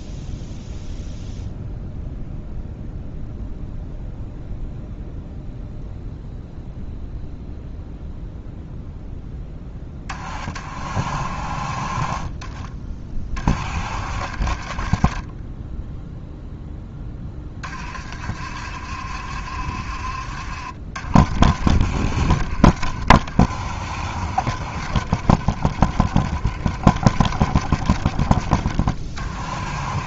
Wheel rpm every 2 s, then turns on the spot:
0, 0, 0, 0, 0, 40, 20, 40, 10, 60, 60, 50, 50, 40, 30.
none